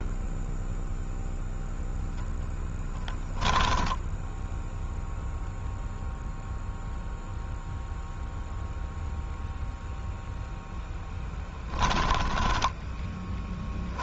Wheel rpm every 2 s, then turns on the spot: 0, 10, 0, 0, 0, 10, 20.
10-12